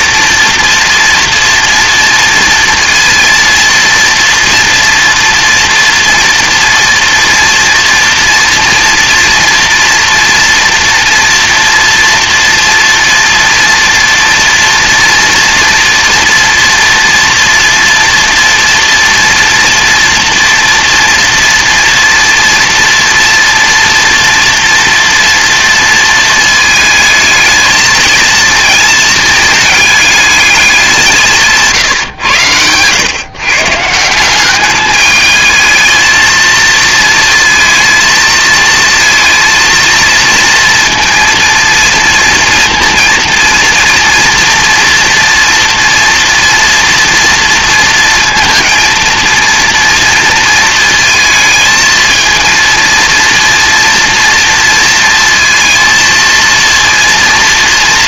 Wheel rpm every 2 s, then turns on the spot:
240, 230, 230, 230, 230, 230, 230, 230, 230, 230, 230, 230, 230, 220, 230, 200, 110, 200, 220, 230, 230, 230, 240, 230, 220, 230, 230, 230, 230.
none